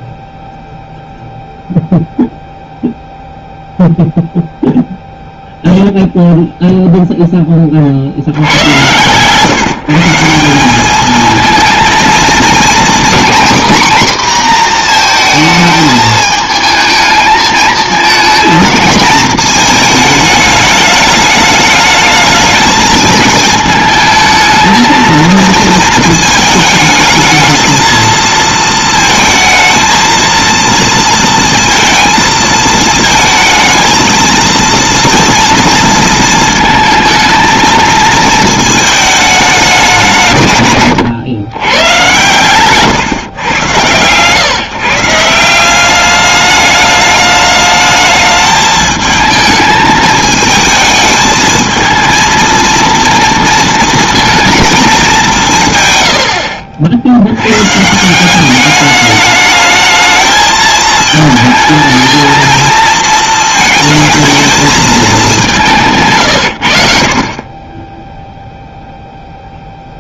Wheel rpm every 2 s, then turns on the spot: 0, 0, 0, 0, 60, 170, 230, 250, 220, 220, 220, 210, 220, 220, 220, 230, 230, 230, 220, 220, 160, 120, 130, 200, 210, 220, 230, 230, 100, 170, 220, 220, 220, 150, 30.
none